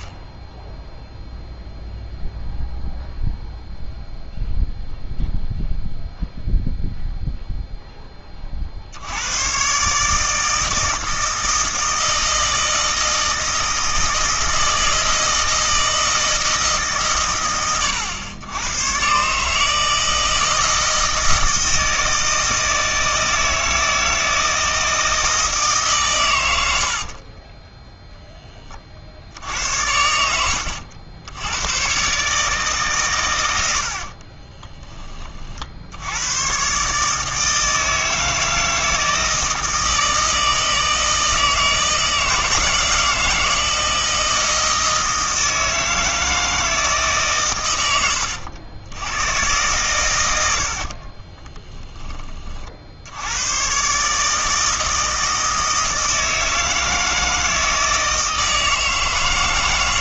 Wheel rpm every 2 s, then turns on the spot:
0, 0, 0, 0, 50, 160, 160, 160, 150, 120, 160, 160, 160, 90, 30, 80, 140, 20, 130, 160, 160, 160, 160, 160, 100, 70, 50, 160, 160, 160.
50-52